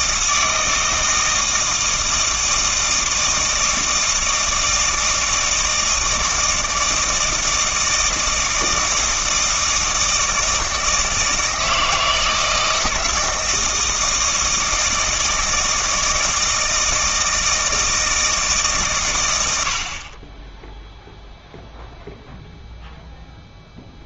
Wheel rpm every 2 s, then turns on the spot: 160, 160, 160, 160, 160, 160, 160, 160, 160, 140, 0, 0.
none